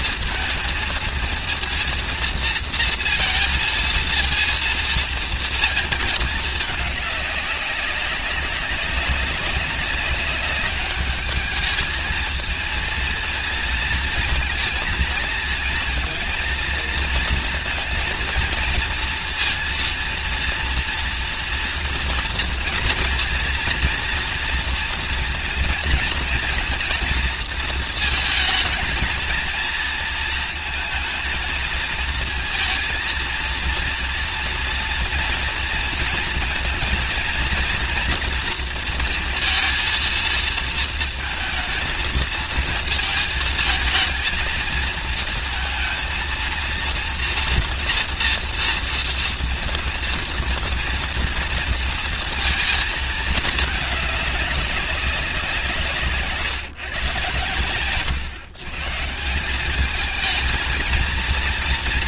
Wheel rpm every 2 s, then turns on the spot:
230, 230, 230, 210, 200, 210, 230, 230, 230, 230, 230, 230, 230, 230, 230, 220, 230, 230, 230, 230, 230, 230, 220, 230, 230, 230, 230, 200, 140, 140, 220.
none